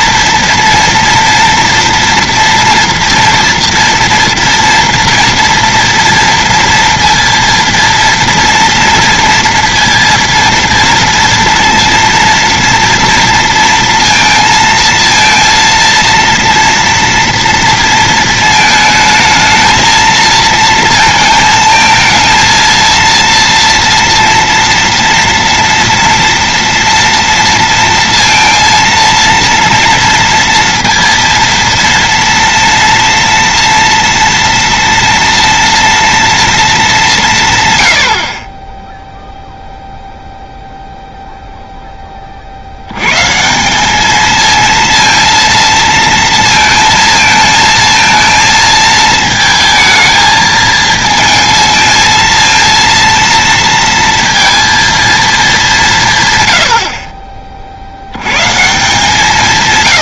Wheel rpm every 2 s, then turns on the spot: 230, 230, 230, 230, 230, 230, 230, 230, 230, 220, 230, 230, 230, 240, 230, 230, 240, 240, 220, 20, 0, 70, 230, 230, 220, 220, 230, 230, 80, 150.
none